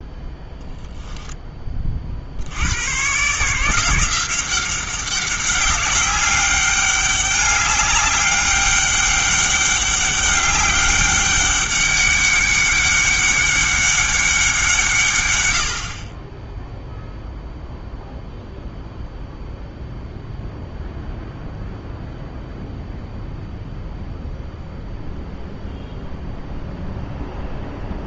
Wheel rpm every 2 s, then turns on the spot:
0, 110, 190, 200, 200, 200, 200, 170, 0, 0, 0, 0, 0, 0.
none